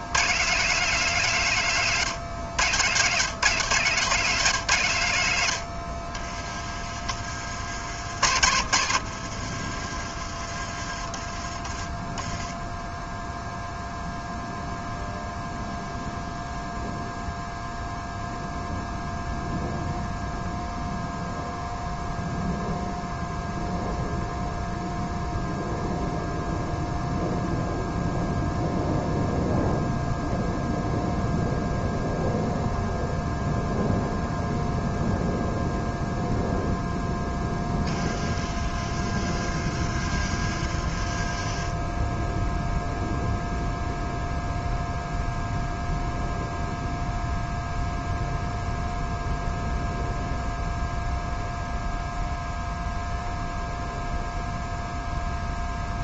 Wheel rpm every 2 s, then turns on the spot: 170, 130, 100, 40, 70, 30, 0, 0, 0, 0, 0, 0, 0, 0, 0, 0, 0, 0, 10, 30, 20, 0, 0, 0, 0, 0, 0, 0.
6-12 38-42